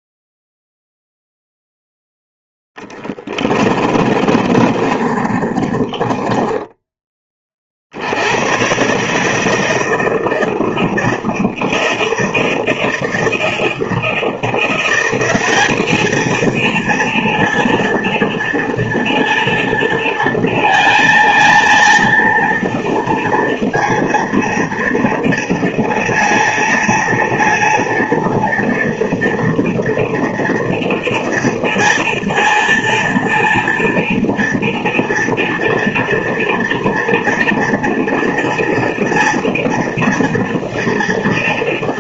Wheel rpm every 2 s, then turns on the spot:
0, 0, 30, 20, 100, 160, 160, 170, 230, 230, 230, 230, 230, 230, 230, 230, 230, 230, 230, 230, 230.
4-8